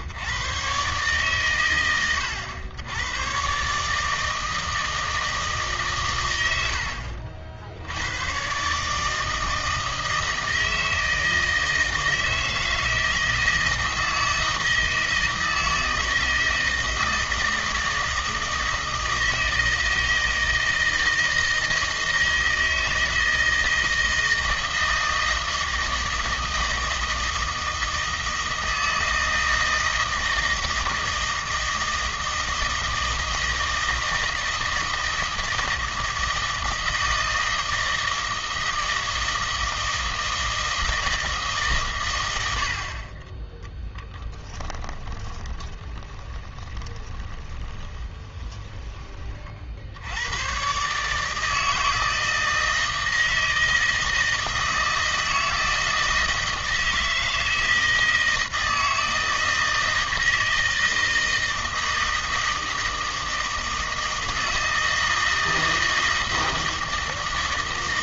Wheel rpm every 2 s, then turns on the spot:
130, 90, 160, 90, 130, 160, 160, 160, 160, 160, 160, 160, 160, 160, 160, 160, 160, 160, 160, 160, 160, 80, 10, 20, 20, 120, 160, 160, 160, 160, 160, 160, 160, 160.
44-50